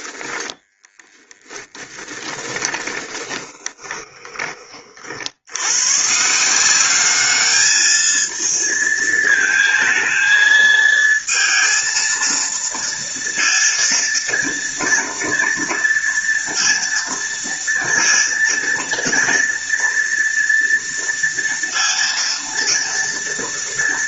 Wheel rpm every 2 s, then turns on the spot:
10, 20, 50, 200, 220, 220, 230, 230, 230, 230, 230, 230.
0-4